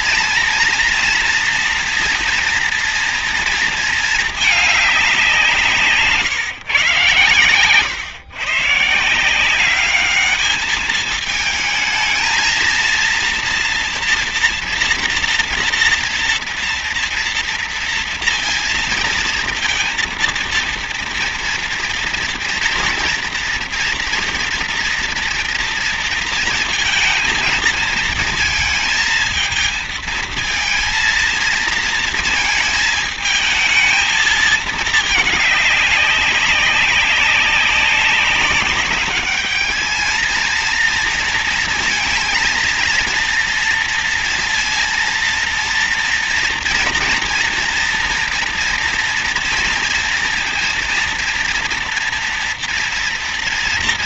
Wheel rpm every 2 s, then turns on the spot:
240, 230, 210, 120, 140, 210, 230, 240, 230, 230, 230, 230, 230, 230, 220, 230, 220, 220, 190, 200, 230, 230, 230, 230, 230, 230, 230.
none